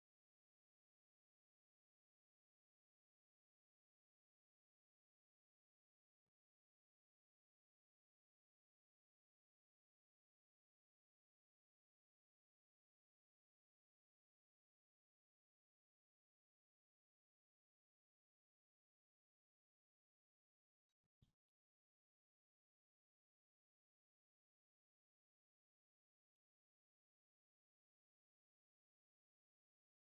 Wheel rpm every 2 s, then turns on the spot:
0, 0, 0, 0, 0, 0, 0, 0, 0, 0, 0, 0, 0, 0, 0.
none